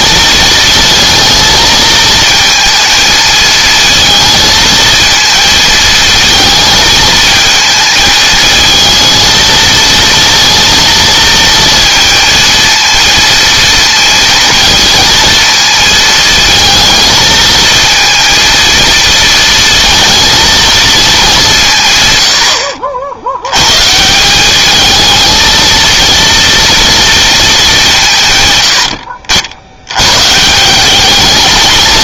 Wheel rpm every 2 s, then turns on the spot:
220, 220, 220, 220, 220, 230, 230, 230, 220, 230, 200, 70, 220, 220, 70, 210.
none